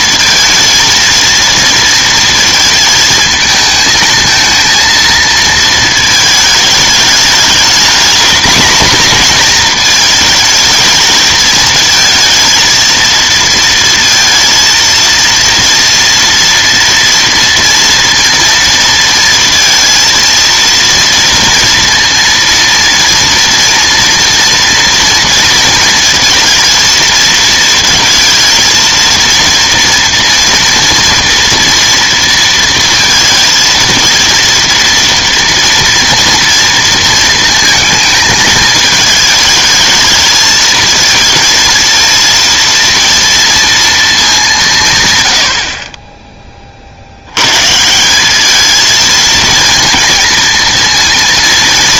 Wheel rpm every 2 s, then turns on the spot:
230, 220, 230, 210, 230, 220, 230, 230, 230, 230, 230, 230, 230, 230, 230, 230, 230, 230, 230, 220, 220, 230, 200, 30, 210, 230.
none